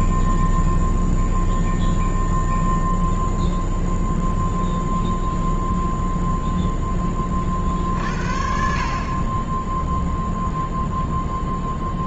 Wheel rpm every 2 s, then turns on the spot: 0, 0, 0, 0, 60, 0.
none